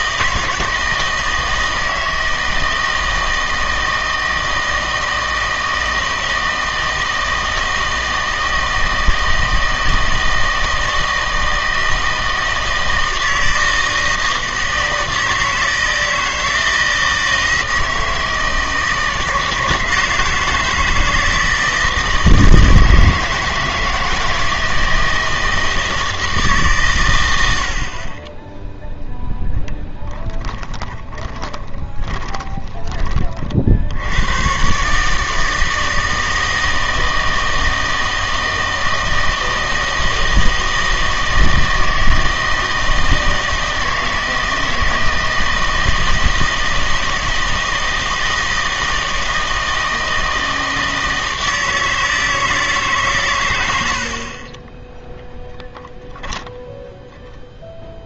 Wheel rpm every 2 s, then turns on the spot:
160, 160, 160, 160, 160, 160, 160, 160, 160, 160, 170, 160, 160, 140, 0, 10, 20, 130, 160, 160, 160, 160, 160, 160, 160, 160, 150, 20, 0.
30-34